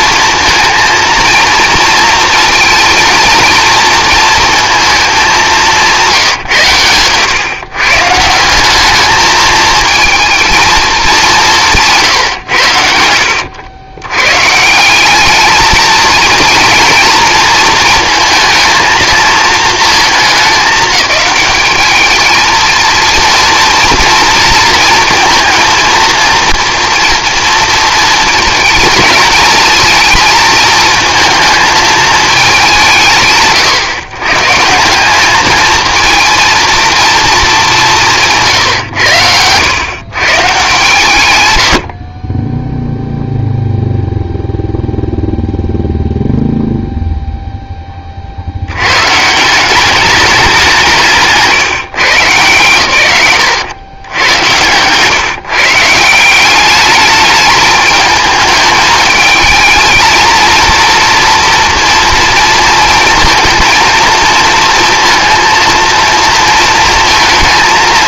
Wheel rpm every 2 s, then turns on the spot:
230, 230, 220, 120, 190, 220, 90, 170, 230, 220, 210, 230, 230, 230, 220, 220, 190, 150, 230, 160, 130, 0, 0, 0, 90, 190, 140, 120, 190, 220, 230, 230, 230, 230.
38-40